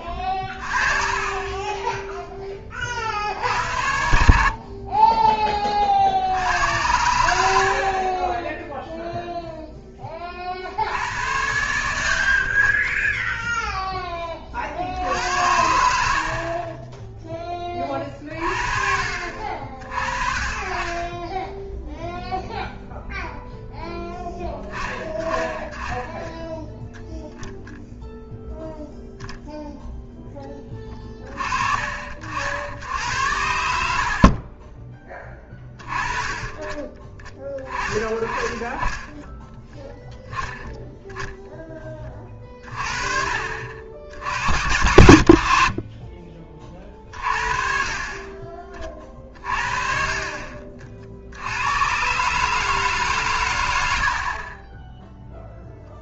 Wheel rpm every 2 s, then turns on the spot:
30, 30, 30, 90, 0, 70, 30, 60, 20, 40, 30, 0, 20, 0, 0, 30, 80, 20, 20, 20, 10, 30, 80, 30, 40, 50, 150, 10.
none